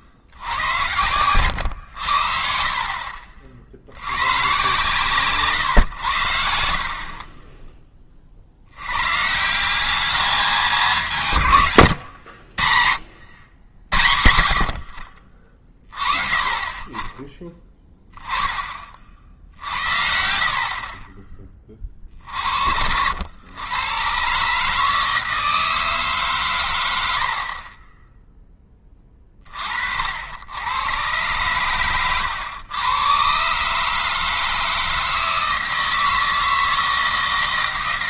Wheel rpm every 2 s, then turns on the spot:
60, 60, 130, 60, 60, 200, 80, 70, 30, 20, 50, 50, 140, 130, 10, 90, 110, 160, 160.
none